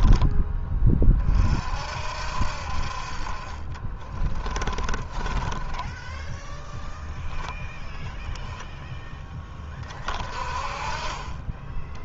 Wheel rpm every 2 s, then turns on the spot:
30, 50, 20, 0, 20, 40.
4-6